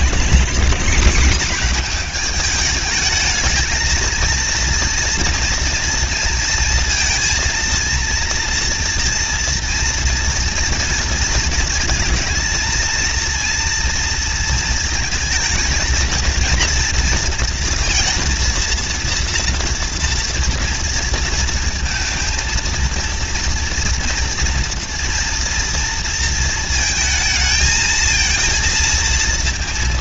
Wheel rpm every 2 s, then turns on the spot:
210, 210, 230, 230, 230, 230, 220, 230, 230, 230, 230, 230, 230, 230, 230.
none